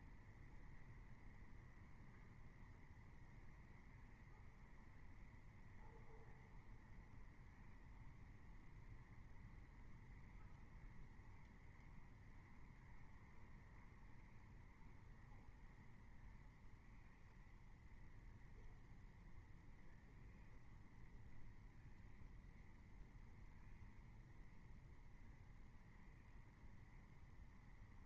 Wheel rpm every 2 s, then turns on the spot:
0, 0, 0, 0, 0, 0, 0, 0, 0, 0, 0, 0, 0, 0.
none